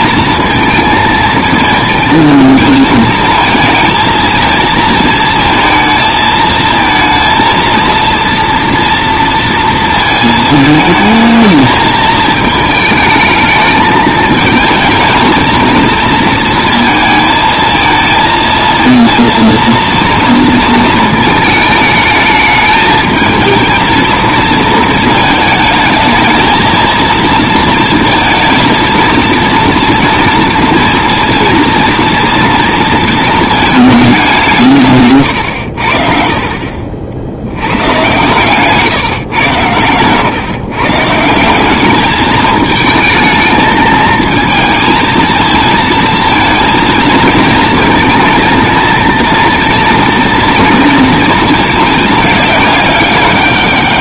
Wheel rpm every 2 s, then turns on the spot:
230, 220, 230, 230, 230, 220, 220, 220, 230, 230, 230, 220, 230, 220, 230, 230, 230, 170, 50, 140, 130, 220, 220, 230, 230, 230, 210.
none